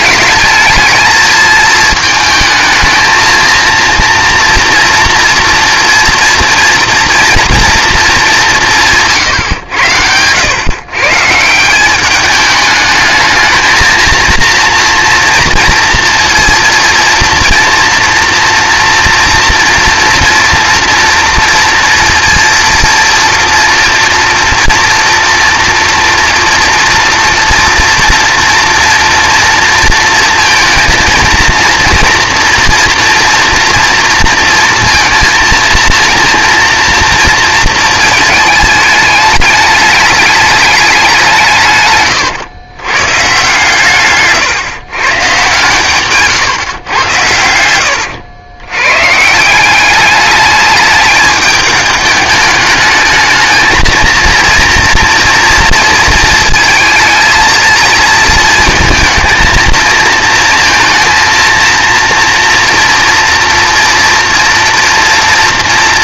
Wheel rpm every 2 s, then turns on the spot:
220, 220, 230, 230, 180, 110, 210, 230, 230, 230, 230, 230, 230, 230, 230, 230, 240, 230, 230, 220, 210, 110, 140, 120, 100, 210, 210, 230, 220, 230, 230, 240, 230.
none